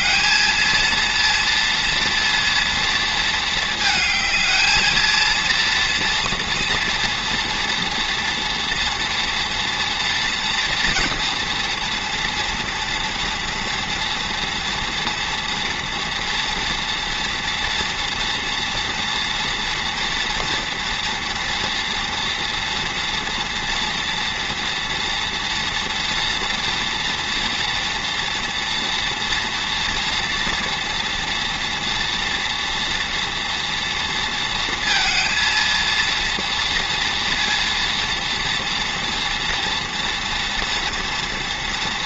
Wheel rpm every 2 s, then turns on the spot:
220, 230, 220, 230, 230, 230, 230, 230, 240, 230, 230, 240, 230, 230, 230, 230, 240, 230, 230, 240, 240.
none